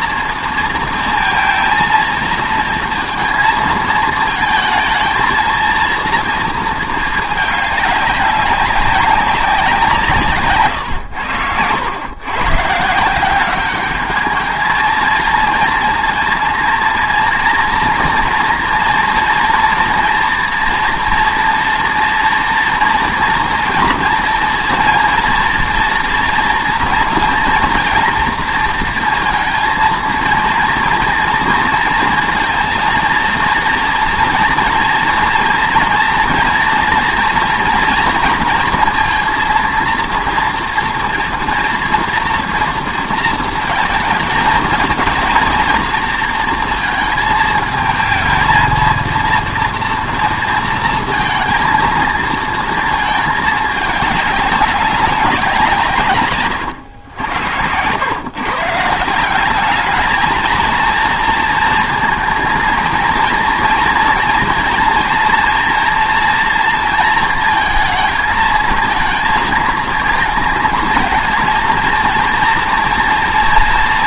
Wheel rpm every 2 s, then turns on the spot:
230, 230, 230, 230, 200, 130, 150, 220, 230, 240, 230, 230, 230, 240, 230, 230, 230, 230, 240, 230, 230, 230, 220, 230, 220, 230, 220, 200, 110, 150, 230, 230, 230, 230, 220, 230, 230.
none